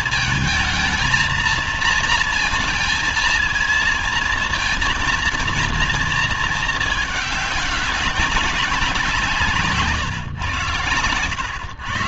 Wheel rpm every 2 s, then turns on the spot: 220, 230, 230, 220, 200, 130.
none